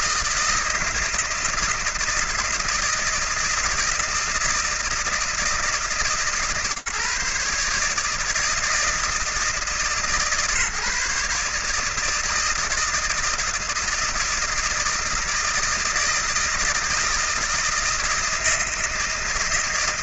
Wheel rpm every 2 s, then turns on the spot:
160, 160, 160, 150, 160, 150, 160, 160, 160, 160.
none